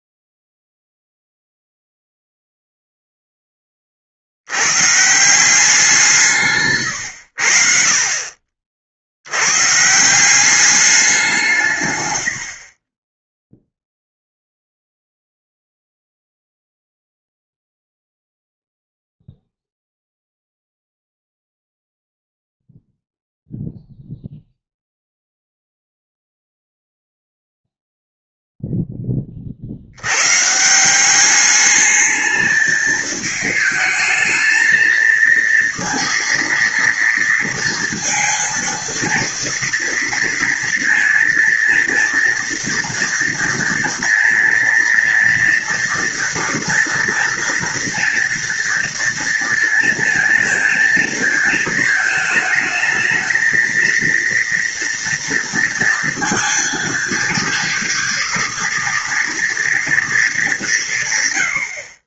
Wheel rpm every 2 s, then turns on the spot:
0, 0, 100, 140, 50, 190, 50, 0, 0, 0, 0, 0, 0, 0, 0, 150, 220, 220, 230, 230, 230, 230, 230, 240, 230, 230, 220, 230, 230, 240, 170.
12-14